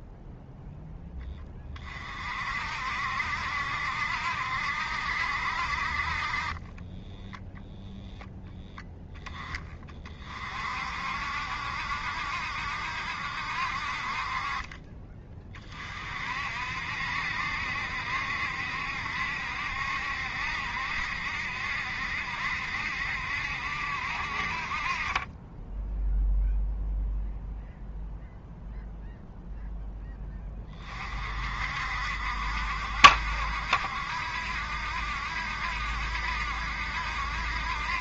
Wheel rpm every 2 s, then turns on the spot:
10, 60, 70, 20, 10, 60, 70, 30, 60, 70, 70, 70, 40, 0, 0, 30, 60, 70, 70.
6-8